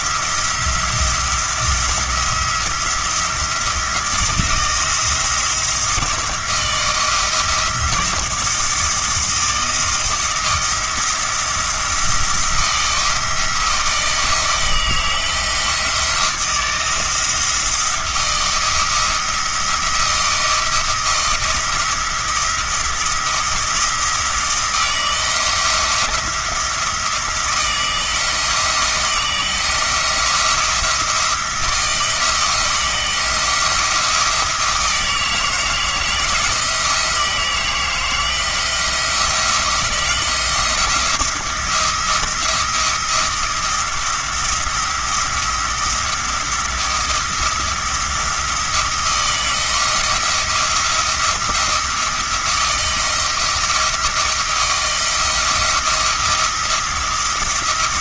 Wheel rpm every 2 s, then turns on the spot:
170, 170, 170, 160, 160, 170, 170, 160, 170, 170, 170, 170, 170, 170, 160, 170, 170, 160, 160, 170, 170, 170, 170, 170, 170, 170, 170, 170, 170.
none